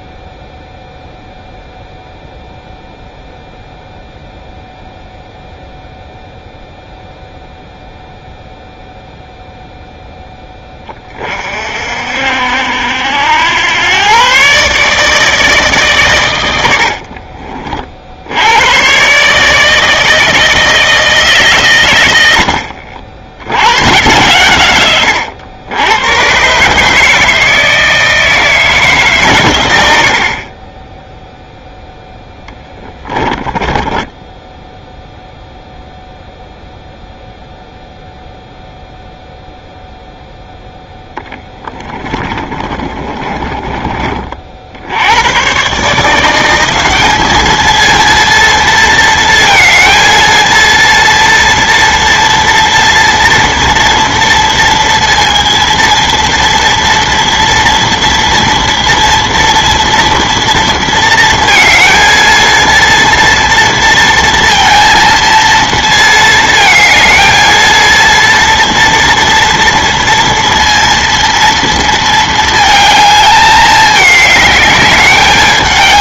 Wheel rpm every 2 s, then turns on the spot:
0, 0, 0, 0, 0, 20, 70, 140, 90, 100, 160, 80, 120, 130, 160, 30, 10, 0, 0, 0, 0, 30, 60, 180, 230, 230, 230, 230, 230, 230, 230, 230, 230, 230, 230, 230, 220, 210.
32-34 42-44